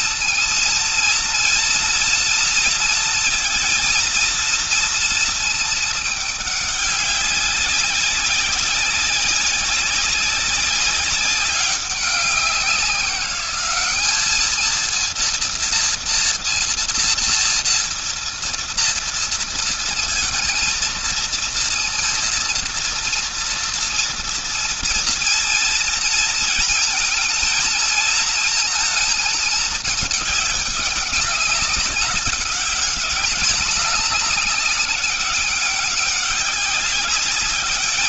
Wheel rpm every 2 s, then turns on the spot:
230, 230, 230, 200, 190, 200, 190, 230, 230, 230, 230, 230, 230, 230, 220, 200, 210, 190, 200.
none